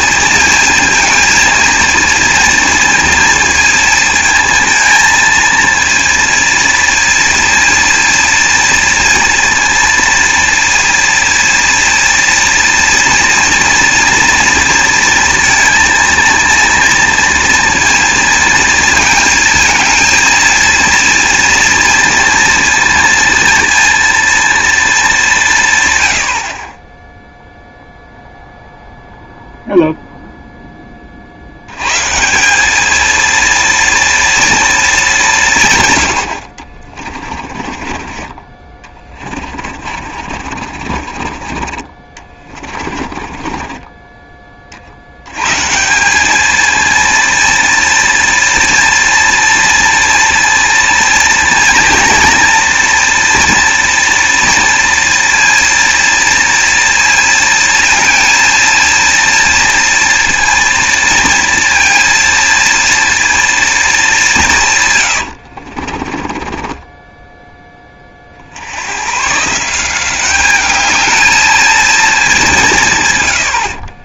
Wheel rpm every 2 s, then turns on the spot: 230, 230, 230, 230, 230, 230, 230, 230, 230, 230, 230, 230, 230, 30, 0, 10, 200, 230, 40, 20, 40, 30, 40, 220, 230, 230, 230, 230, 230, 230, 230, 230, 130, 20, 80, 210, 170.
36-44 66-68